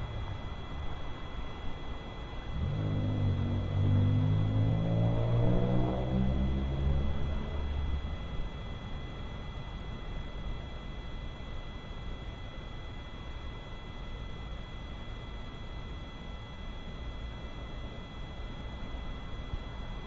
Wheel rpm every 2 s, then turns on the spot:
0, 0, 0, 0, 0, 0, 0, 0, 0, 0.
none